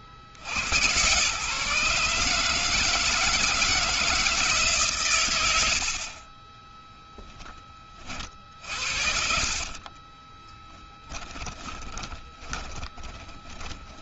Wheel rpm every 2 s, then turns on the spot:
60, 150, 160, 30, 40, 20, 20.
8-14